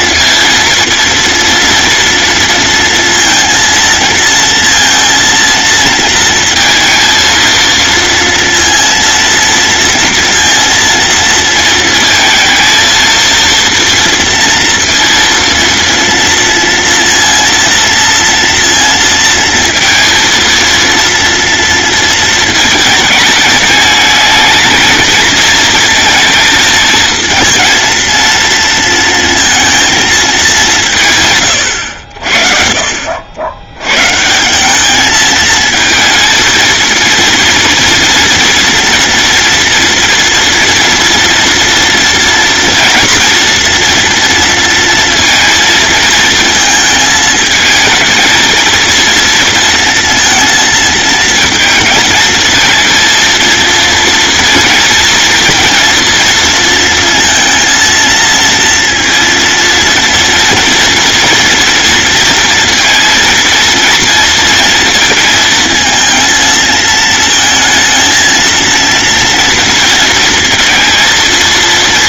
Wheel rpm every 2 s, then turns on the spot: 230, 230, 230, 230, 230, 230, 230, 230, 230, 230, 230, 220, 220, 220, 230, 170, 50, 200, 230, 230, 230, 230, 230, 220, 230, 230, 230, 230, 230, 230, 230, 230, 230, 220, 230, 230.
none